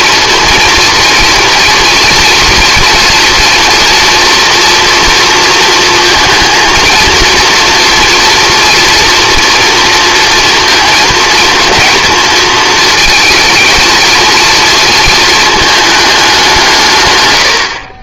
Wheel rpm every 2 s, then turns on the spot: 230, 230, 230, 230, 230, 230, 220, 230, 170.
none